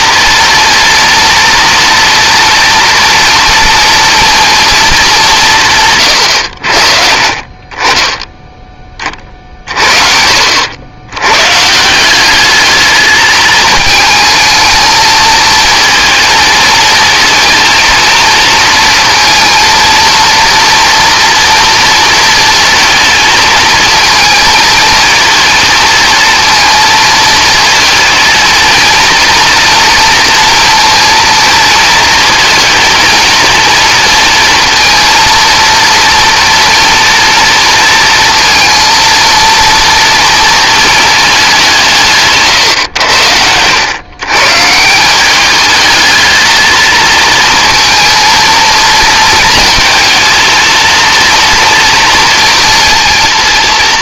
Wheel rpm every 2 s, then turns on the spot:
240, 230, 220, 80, 10, 80, 210, 220, 230, 230, 230, 230, 220, 230, 230, 230, 230, 220, 230, 230, 230, 140, 150, 220, 220, 220, 230.
none